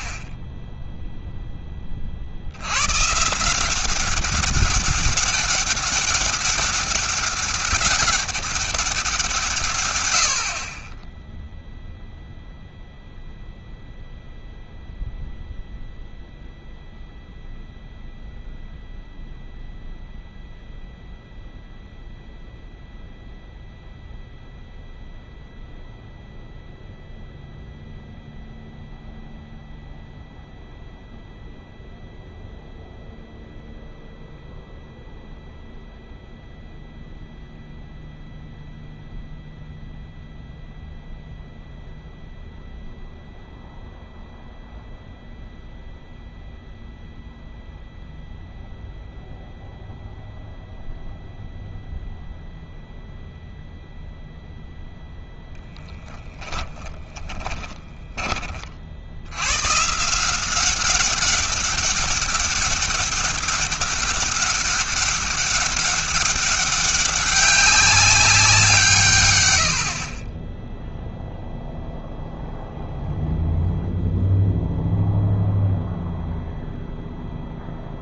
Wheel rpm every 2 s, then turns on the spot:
0, 130, 200, 200, 180, 20, 0, 0, 0, 0, 0, 0, 0, 0, 0, 0, 0, 0, 0, 0, 0, 0, 0, 0, 0, 0, 0, 0, 10, 40, 190, 200, 200, 200, 170, 10, 0, 0, 0.
56-58